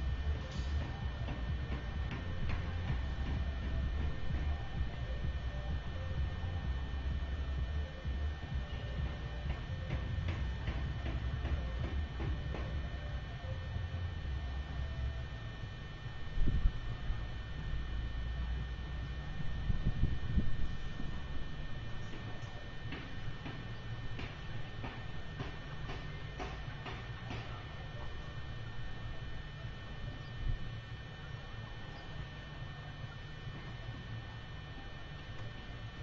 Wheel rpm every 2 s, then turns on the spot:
0, 0, 0, 0, 0, 0, 0, 0, 0, 0, 0, 0, 0, 0, 0, 0, 0, 0.
none